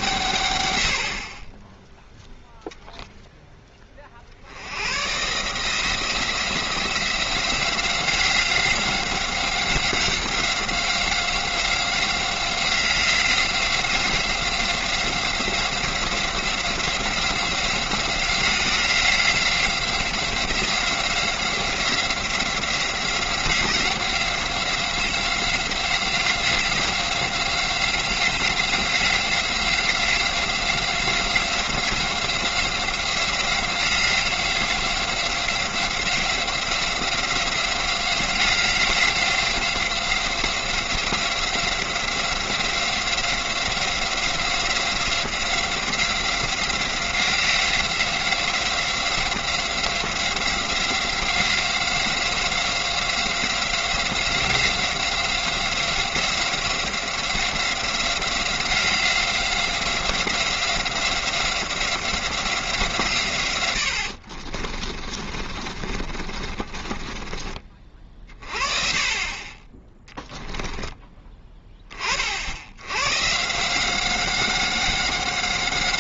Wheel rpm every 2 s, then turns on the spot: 100, 0, 90, 170, 180, 180, 180, 180, 180, 180, 180, 180, 180, 180, 180, 180, 180, 180, 180, 180, 180, 180, 180, 180, 180, 180, 180, 180, 180, 180, 180, 170, 40, 40, 30, 10, 80, 190.
64-72